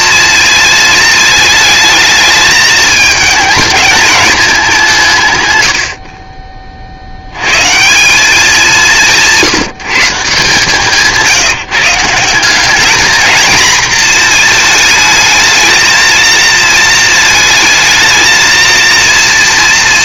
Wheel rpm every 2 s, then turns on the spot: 220, 220, 190, 40, 200, 160, 210, 220, 220, 230.
none